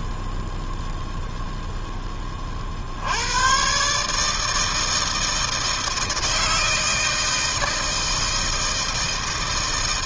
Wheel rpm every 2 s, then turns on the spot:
0, 60, 160, 160, 160.
none